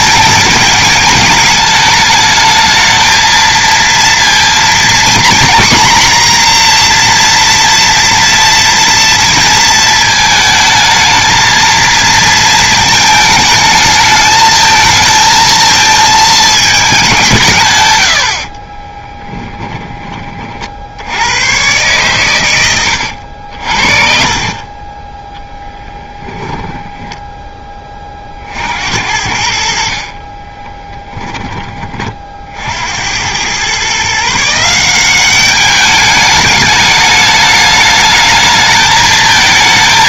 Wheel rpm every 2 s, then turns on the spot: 220, 220, 230, 240, 230, 220, 230, 220, 210, 30, 60, 100, 30, 10, 70, 10, 70, 180, 210, 220.
18-20 22-26 30-32